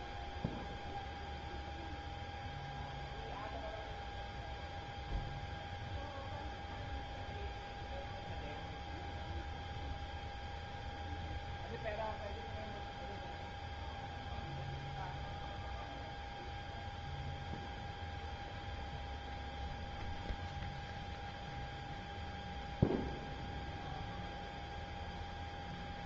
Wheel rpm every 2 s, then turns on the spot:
0, 0, 0, 0, 0, 0, 0, 0, 0, 0, 0, 0, 0.
none